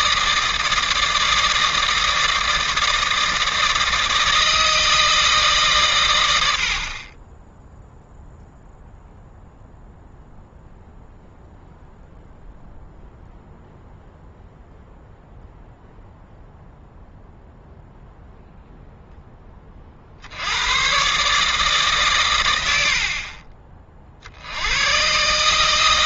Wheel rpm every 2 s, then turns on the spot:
160, 160, 160, 50, 0, 0, 0, 0, 0, 0, 110, 80, 100.
none